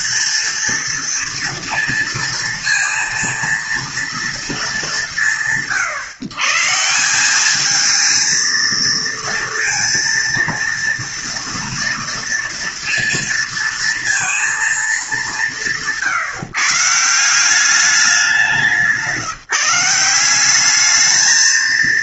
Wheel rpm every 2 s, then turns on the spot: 230, 230, 160, 160, 230, 230, 230, 220, 150, 180, 210.
none